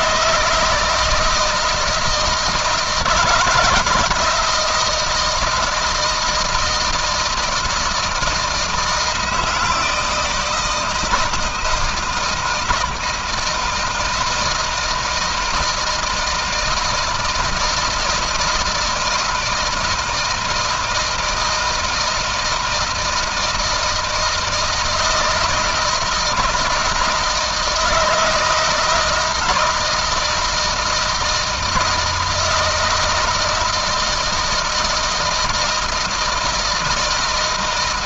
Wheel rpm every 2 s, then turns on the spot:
160, 170, 170, 160, 160, 160, 160, 160, 160, 160, 160, 160, 160, 160, 160, 160, 160, 160, 160.
none